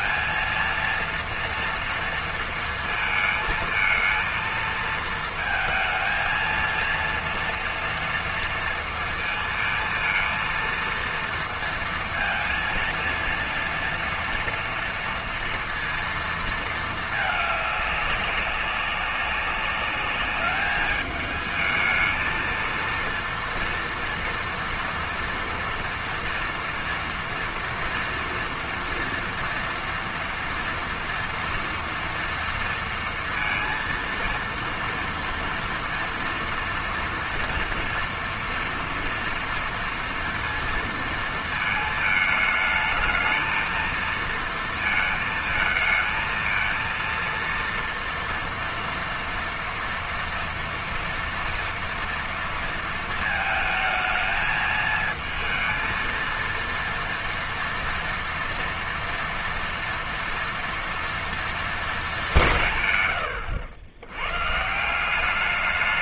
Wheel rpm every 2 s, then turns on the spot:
230, 220, 220, 230, 230, 230, 230, 230, 220, 200, 210, 230, 230, 240, 230, 230, 230, 230, 230, 230, 230, 220, 230, 230, 230, 230, 230, 220, 230, 230, 230, 140, 180.
none